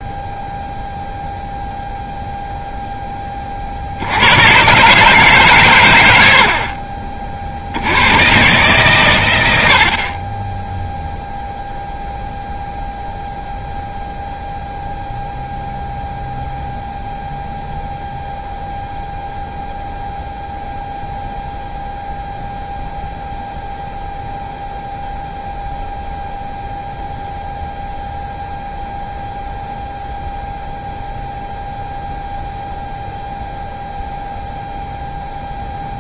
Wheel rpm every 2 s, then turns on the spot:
0, 0, 120, 50, 130, 10, 0, 0, 0, 0, 0, 0, 0, 0, 0, 0, 0, 0.
none